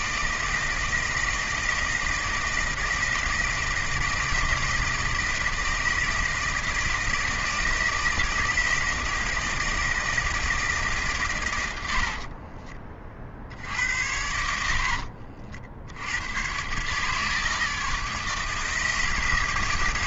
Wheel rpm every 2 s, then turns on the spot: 160, 160, 160, 160, 160, 150, 30, 80, 130, 160.
none